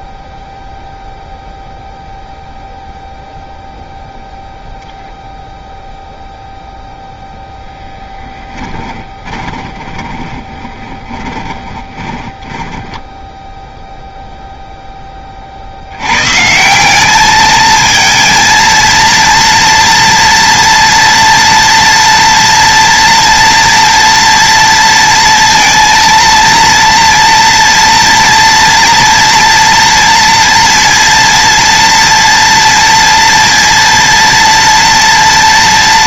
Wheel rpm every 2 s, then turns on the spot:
0, 0, 0, 0, 10, 20, 10, 10, 190, 230, 230, 230, 230, 230, 240, 230, 230, 230.
8-14